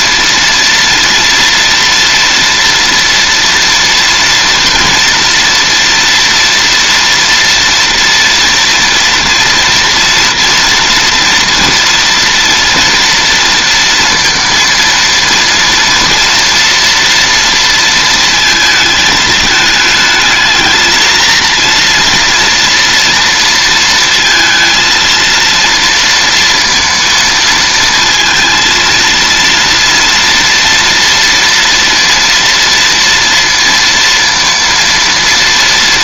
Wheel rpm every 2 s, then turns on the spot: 230, 230, 240, 230, 230, 230, 230, 230, 230, 220, 230, 230, 230, 230, 230, 240, 230, 230.
none